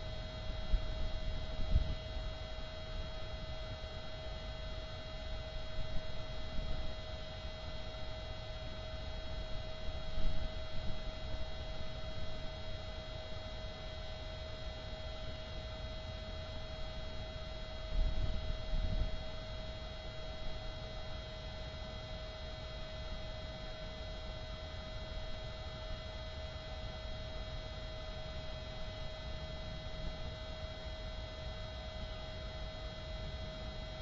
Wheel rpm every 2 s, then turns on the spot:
0, 0, 0, 0, 0, 0, 0, 0, 0, 0, 0, 0, 0, 0, 0, 0, 0.
none